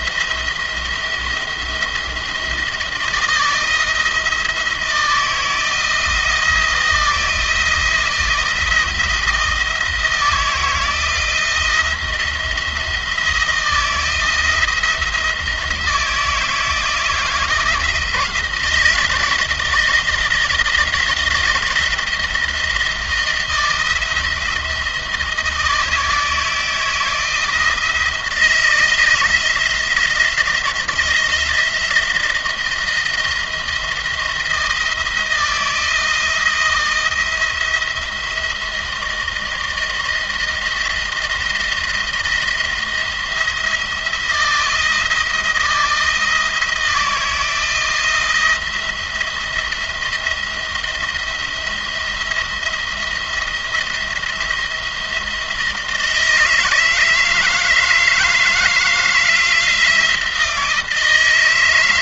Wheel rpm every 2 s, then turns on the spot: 170, 160, 160, 170, 170, 160, 170, 170, 160, 160, 170, 170, 160, 160, 160, 170, 170, 160, 160, 170, 160, 170, 170, 160, 170, 170, 170, 170, 160, 160, 160.
none